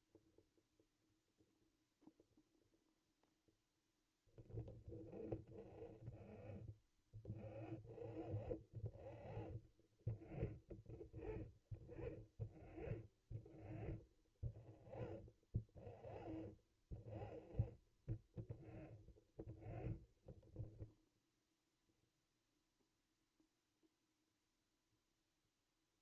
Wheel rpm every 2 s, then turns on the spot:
0, 0, 0, 0, 0, 0, 0, 0, 0, 0, 0, 0, 0.
none